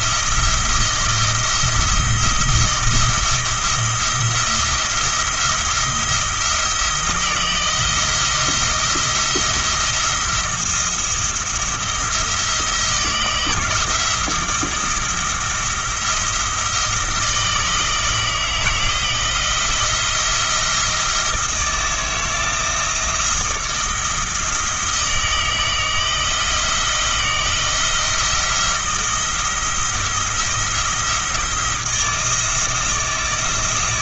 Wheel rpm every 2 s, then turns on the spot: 170, 170, 170, 170, 170, 170, 170, 170, 170, 160, 170, 160, 160, 160, 170, 170, 160.
none